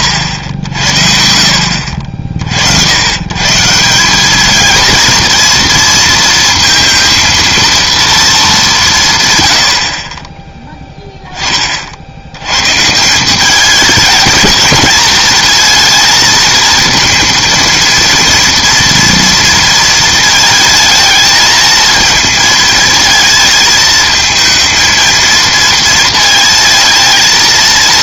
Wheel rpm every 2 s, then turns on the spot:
80, 80, 220, 230, 200, 10, 120, 220, 230, 230, 220, 220, 220, 230.
none